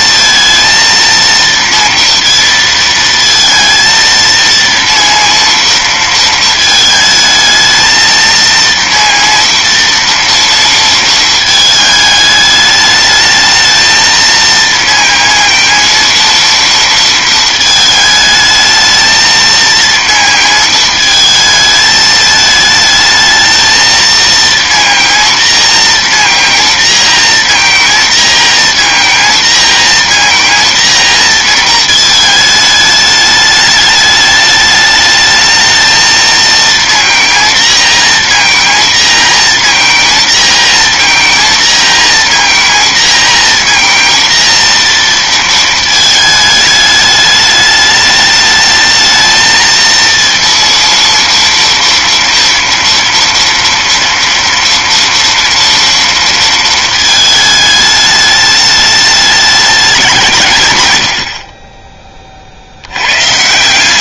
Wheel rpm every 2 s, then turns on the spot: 230, 230, 230, 220, 230, 230, 210, 230, 230, 220, 230, 220, 230, 230, 230, 230, 220, 210, 230, 230, 230, 230, 230, 210, 220, 230, 230, 230, 230, 210, 130, 70.
none